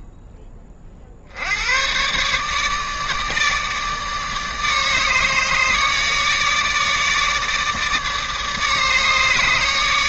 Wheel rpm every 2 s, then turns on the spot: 60, 150, 150, 150, 150.
none